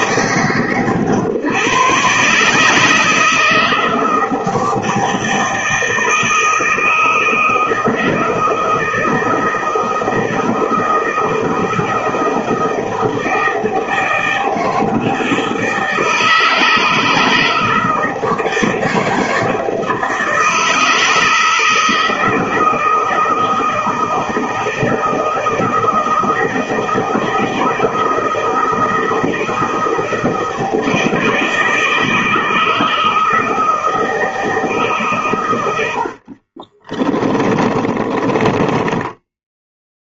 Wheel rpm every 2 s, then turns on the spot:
140, 150, 160, 160, 160, 160, 160, 160, 160, 170, 160, 160, 160, 160, 160, 160, 160, 160, 40, 20.
36-40